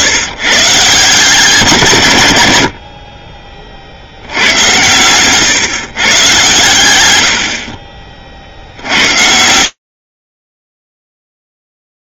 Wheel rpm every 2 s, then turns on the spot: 140, 90, 100, 130, 50, 40.
none